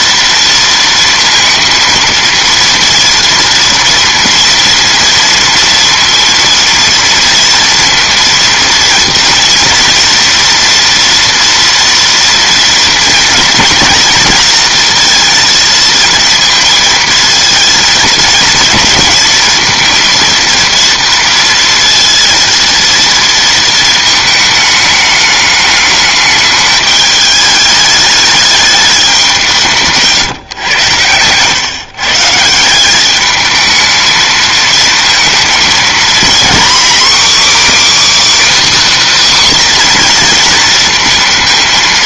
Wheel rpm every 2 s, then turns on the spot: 230, 230, 230, 230, 230, 230, 230, 230, 230, 230, 230, 230, 220, 210, 210, 130, 170, 220, 260, 320, 240.
none